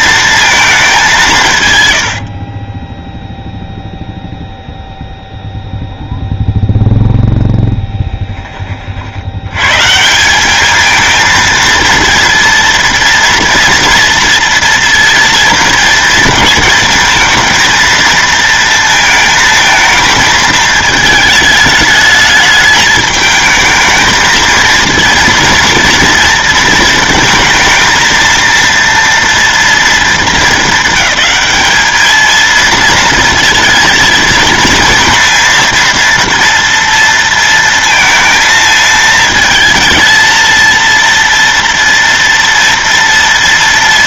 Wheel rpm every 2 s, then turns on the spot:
210, 20, 0, 0, 40, 220, 230, 230, 220, 230, 220, 220, 230, 230, 230, 220, 230, 230, 230, 220, 230, 230.
2-4